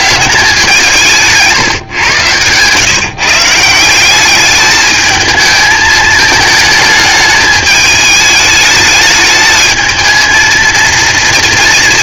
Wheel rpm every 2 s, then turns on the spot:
180, 130, 210, 220, 210, 230.
none